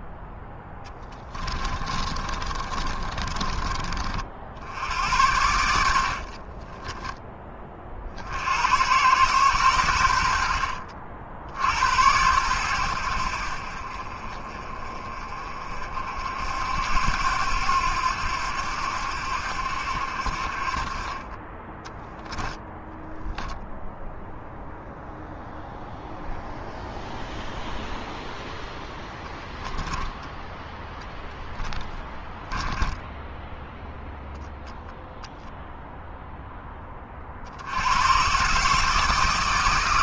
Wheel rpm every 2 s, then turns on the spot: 30, 30, 80, 20, 100, 60, 90, 40, 80, 80, 30, 0, 0, 0, 0, 0, 10, 0, 20, 160.
0-4 32-34